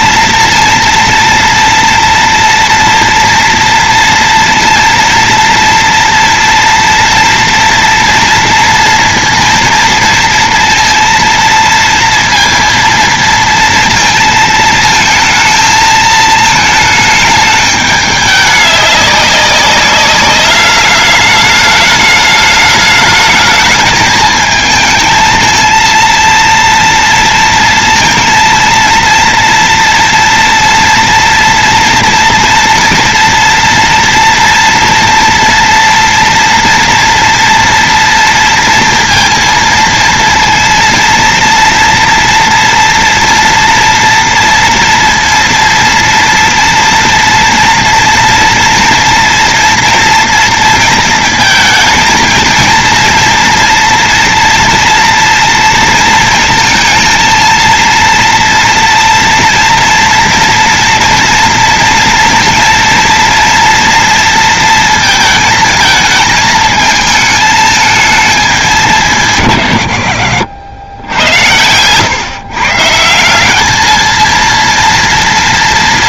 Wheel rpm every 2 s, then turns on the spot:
230, 240, 230, 240, 230, 230, 230, 230, 220, 200, 210, 210, 220, 230, 230, 230, 230, 230, 240, 230, 230, 230, 230, 230, 240, 230, 230, 230, 230, 230, 240, 230, 230, 220, 180, 80, 150, 230.
none